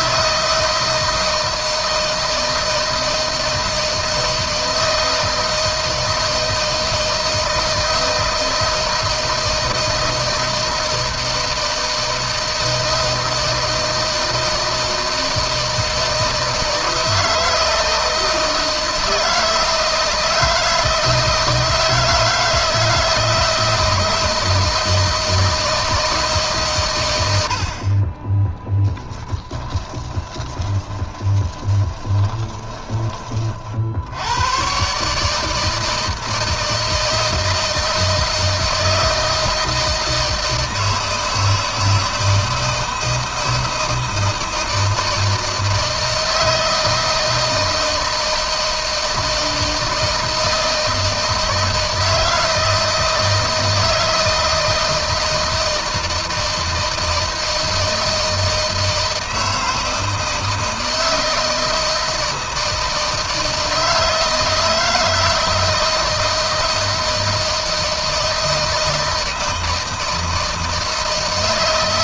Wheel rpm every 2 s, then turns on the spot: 160, 160, 160, 160, 160, 160, 160, 160, 160, 160, 160, 160, 160, 120, 10, 20, 30, 140, 160, 160, 160, 160, 160, 160, 160, 160, 160, 160, 160, 160, 160, 160, 160, 160, 160, 160.
28-32